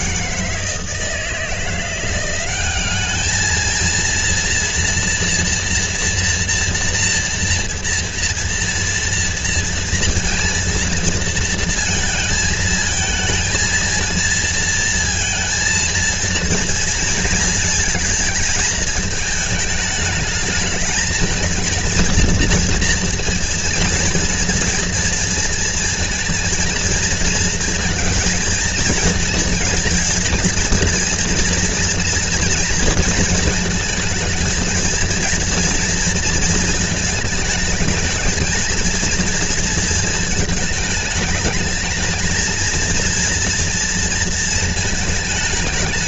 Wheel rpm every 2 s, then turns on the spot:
160, 200, 240, 230, 230, 230, 220, 230, 230, 220, 220, 230, 230, 230, 230, 230, 230, 230, 220, 230, 220, 230, 220.
none